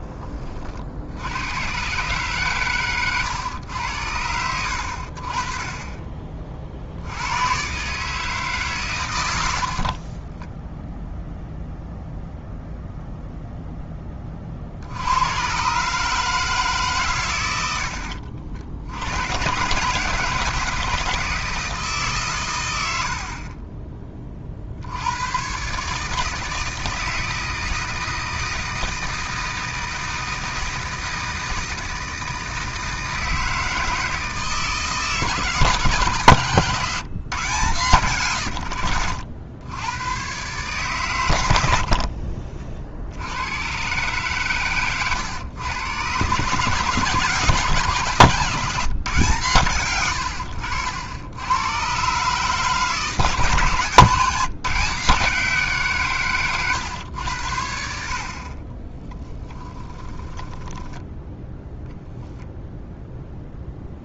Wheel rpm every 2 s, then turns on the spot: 50, 130, 70, 60, 120, 0, 0, 60, 140, 80, 160, 100, 60, 160, 160, 160, 160, 160, 140, 90, 130, 60, 120, 140, 150, 90, 150, 160, 120, 40, 10, 0.
36-38 58-62